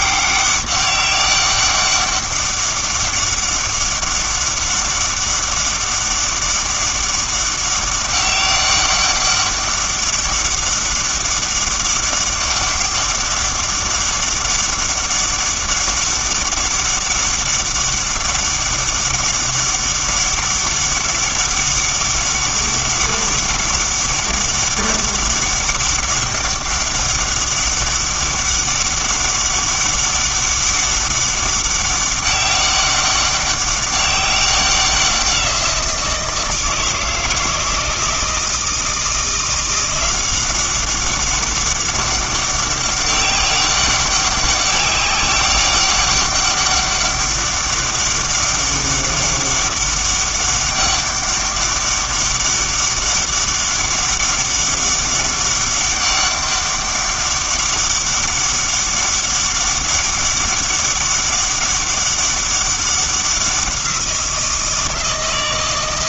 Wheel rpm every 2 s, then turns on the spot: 200, 200, 200, 200, 200, 200, 200, 200, 200, 200, 200, 200, 200, 200, 200, 200, 200, 190, 160, 160, 190, 200, 190, 200, 200, 200, 200, 200, 200, 200, 200, 190, 170.
none